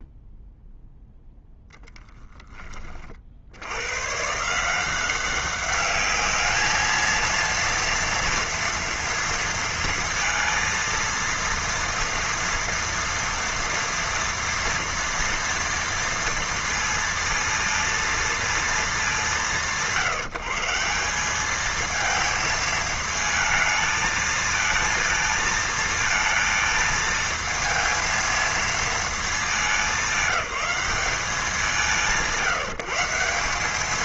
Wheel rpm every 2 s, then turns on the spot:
0, 10, 160, 220, 230, 230, 230, 230, 230, 230, 160, 220, 230, 230, 230, 210, 170.
none